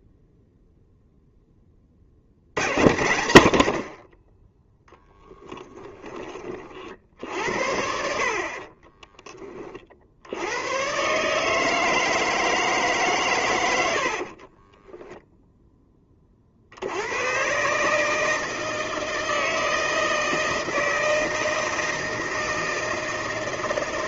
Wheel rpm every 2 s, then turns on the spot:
0, 60, 40, 20, 50, 100, 160, 30, 60, 160, 160, 160.
14-16